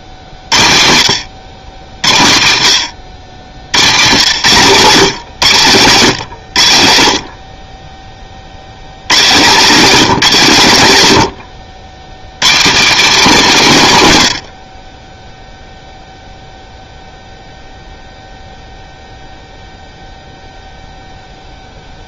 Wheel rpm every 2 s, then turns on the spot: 70, 80, 140, 90, 80, 150, 160, 70, 0, 0, 0.
none